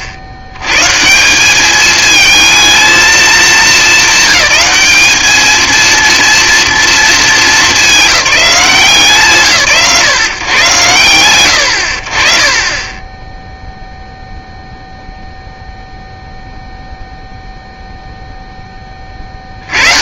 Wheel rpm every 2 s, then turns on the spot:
120, 220, 210, 230, 170, 90, 20, 0, 0, 20.
none